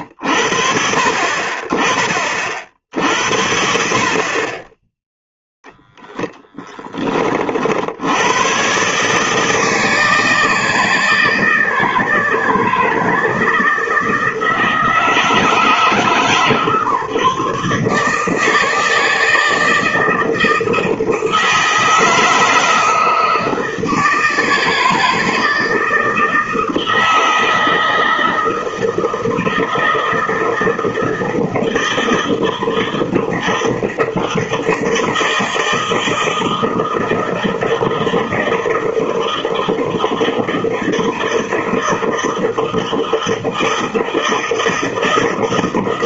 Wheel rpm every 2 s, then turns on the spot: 60, 60, 10, 10, 130, 160, 160, 160, 150, 160, 160, 160, 160, 160, 160, 160, 160, 160, 160, 160, 160, 160, 160.
none